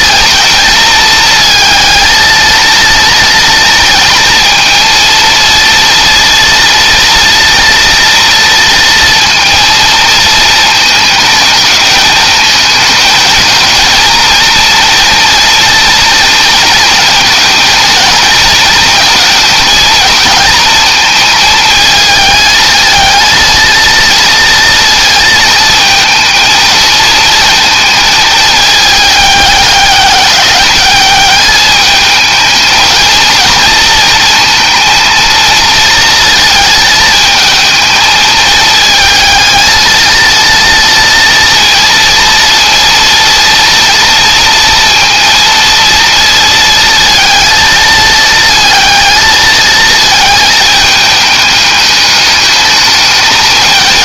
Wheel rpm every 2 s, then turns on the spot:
220, 230, 230, 230, 230, 220, 220, 230, 220, 220, 220, 220, 230, 230, 210, 200, 230, 230, 220, 220, 230, 230, 230, 230, 220, 210, 210.
none